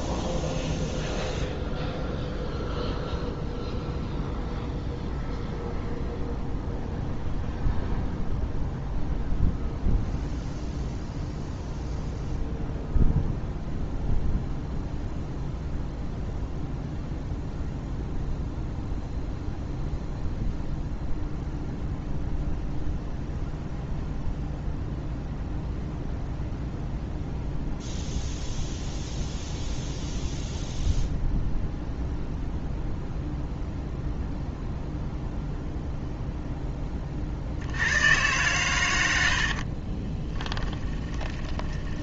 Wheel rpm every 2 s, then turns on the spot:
0, 0, 0, 0, 0, 0, 0, 0, 0, 0, 0, 0, 0, 0, 0, 0, 0, 0, 10, 120, 20.
40-42